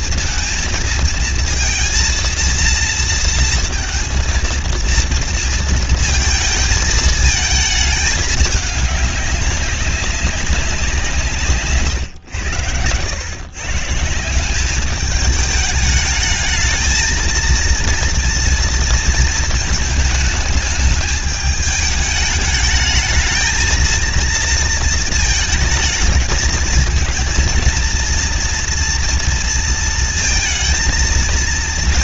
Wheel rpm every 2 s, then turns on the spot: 230, 230, 230, 220, 210, 190, 90, 190, 220, 230, 210, 210, 230, 230, 230, 220.
none